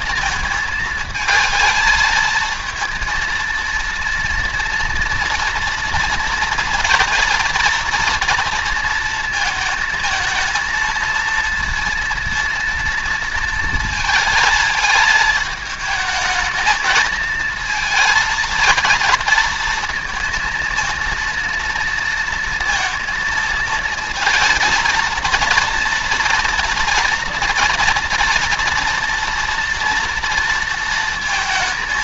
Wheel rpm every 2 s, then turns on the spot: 220, 230, 230, 230, 230, 230, 230, 220, 220, 230, 230, 230, 230, 230, 230, 230.
none